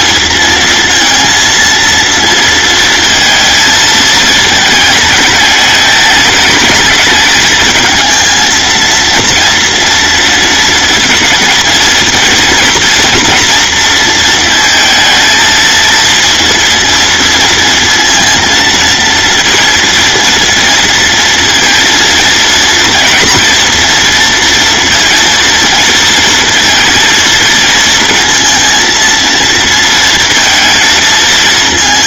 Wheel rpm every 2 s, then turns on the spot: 230, 230, 210, 220, 230, 230, 230, 230, 230, 230, 230, 230, 230, 230, 230, 220.
none